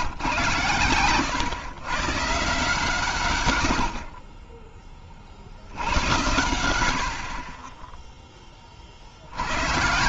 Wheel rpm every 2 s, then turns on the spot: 150, 130, 80, 90, 10.
none